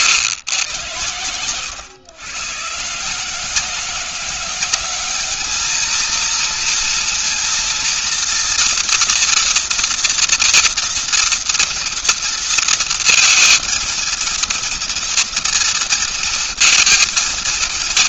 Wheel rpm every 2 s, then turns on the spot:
110, 130, 190, 230, 230, 230, 230, 230, 230.
none